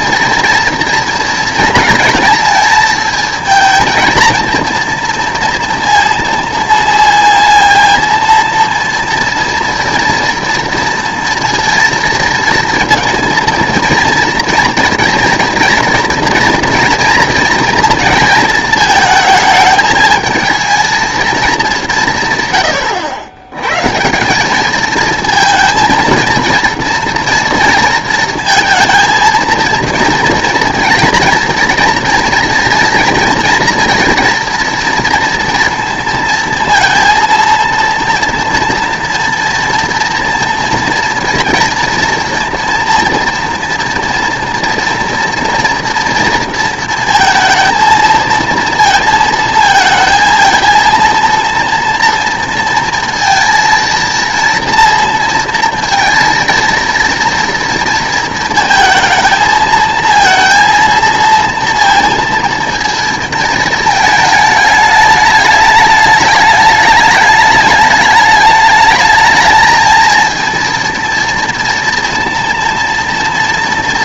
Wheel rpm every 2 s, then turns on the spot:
230, 220, 230, 230, 230, 230, 230, 230, 230, 230, 220, 120, 210, 230, 230, 230, 240, 230, 230, 230, 230, 230, 230, 230, 230, 230, 230, 230, 230, 230, 230, 230, 210, 210, 210, 230, 240.
none